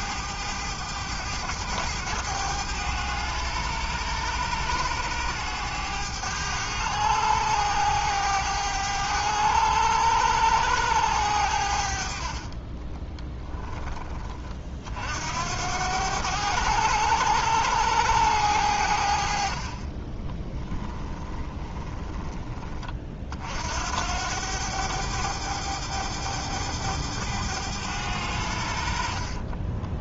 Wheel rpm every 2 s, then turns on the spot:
100, 100, 100, 100, 100, 100, 20, 50, 100, 80, 20, 30, 100, 100, 60.
12-14 20-22